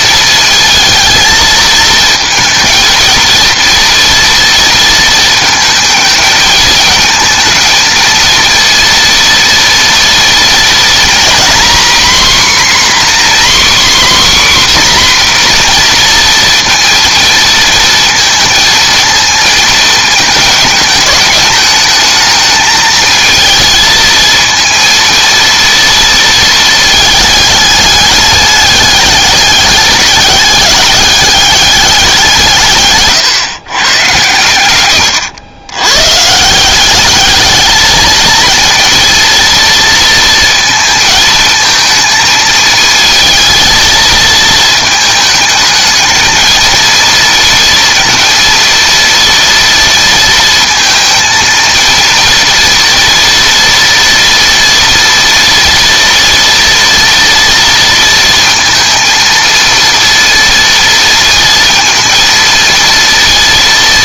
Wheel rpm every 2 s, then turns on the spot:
230, 230, 230, 220, 230, 230, 260, 270, 230, 230, 220, 220, 220, 220, 210, 200, 150, 110, 180, 230, 230, 220, 220, 230, 230, 230, 240, 240, 230, 230, 230, 230.
none